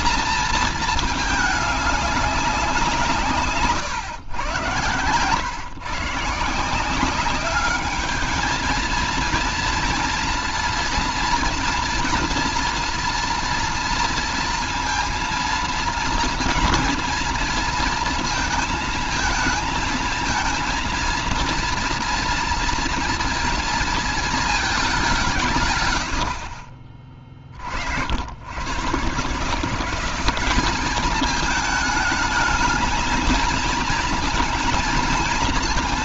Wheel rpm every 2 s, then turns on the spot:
220, 180, 110, 170, 220, 230, 230, 230, 230, 220, 230, 230, 210, 50, 110, 200, 220, 230.
4-6